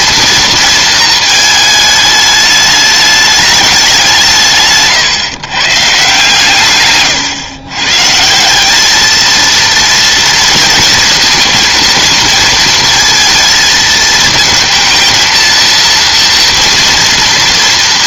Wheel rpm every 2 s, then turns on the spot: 230, 210, 160, 130, 190, 230, 230, 230, 230.
none